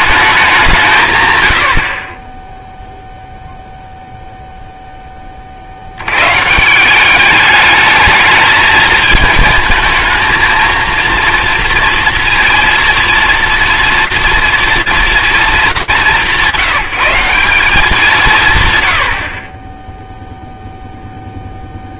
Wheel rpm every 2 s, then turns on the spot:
180, 0, 20, 200, 220, 230, 230, 220, 180, 70, 30.
none